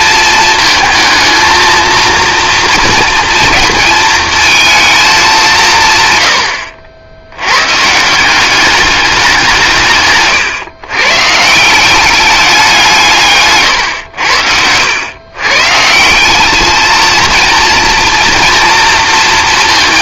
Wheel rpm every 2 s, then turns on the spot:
230, 230, 230, 70, 190, 130, 200, 90, 210, 230.
none